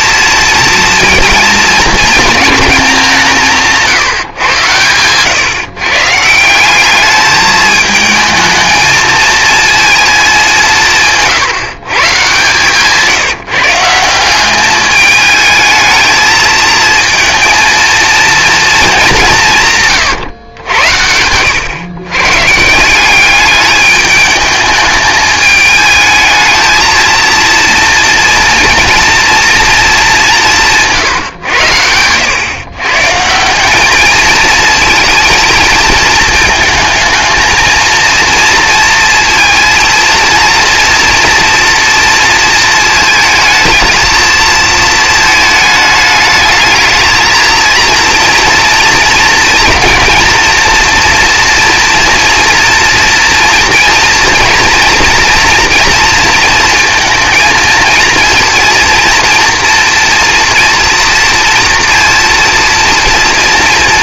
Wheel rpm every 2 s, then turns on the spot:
230, 200, 120, 200, 220, 170, 150, 210, 230, 210, 90, 160, 210, 220, 230, 160, 140, 230, 220, 230, 230, 220, 220, 220, 230, 240, 230, 230, 220, 230, 230, 230.
none